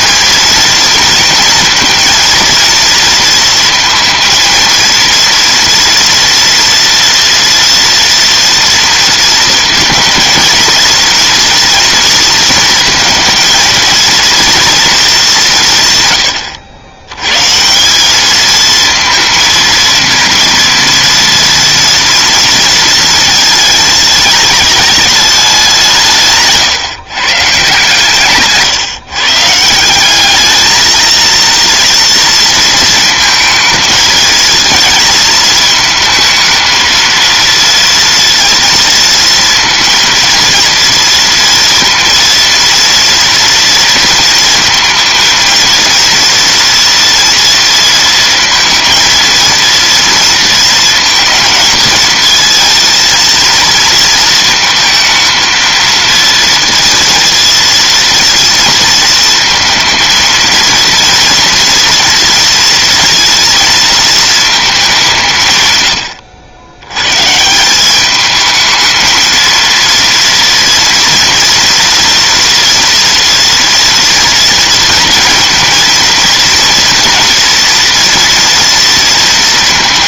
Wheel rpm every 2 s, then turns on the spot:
230, 230, 230, 230, 230, 230, 230, 210, 110, 230, 230, 230, 210, 150, 150, 220, 220, 220, 230, 230, 230, 230, 230, 230, 230, 230, 230, 220, 230, 230, 230, 230, 180, 120, 220, 230, 230, 230, 230, 230.
none